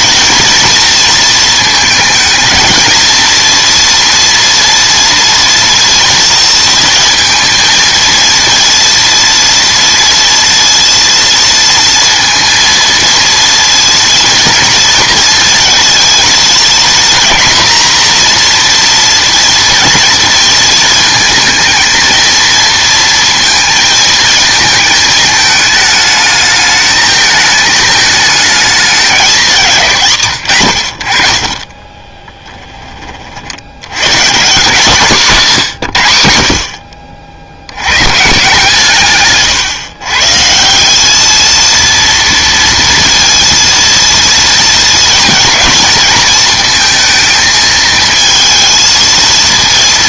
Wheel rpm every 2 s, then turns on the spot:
240, 230, 230, 230, 230, 230, 230, 230, 230, 240, 230, 230, 220, 220, 210, 80, 20, 160, 70, 150, 170, 230, 230, 220, 230.
none